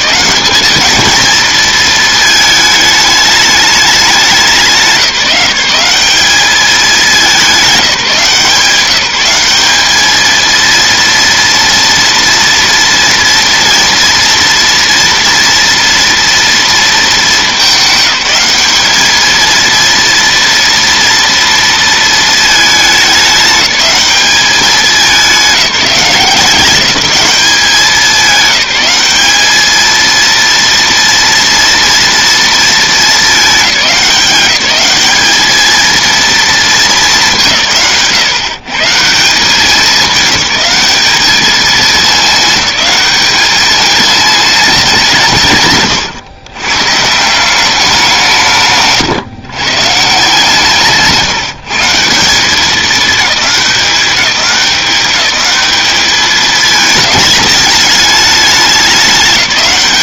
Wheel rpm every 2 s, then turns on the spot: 210, 220, 190, 210, 180, 230, 230, 240, 230, 210, 230, 210, 190, 190, 190, 230, 220, 190, 210, 150, 200, 200, 180, 130, 150, 160, 210, 200, 220, 210.
none